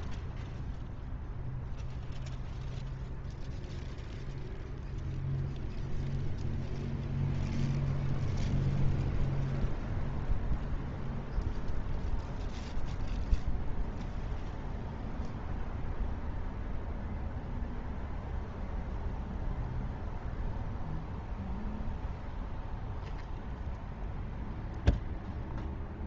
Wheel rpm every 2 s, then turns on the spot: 0, 0, 0, 0, 0, 0, 0, 0, 0, 0, 0, 0, 0.
none